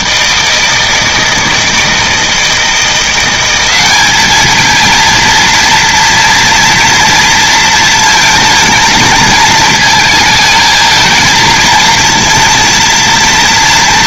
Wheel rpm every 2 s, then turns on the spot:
160, 170, 220, 230, 230, 220, 230.
none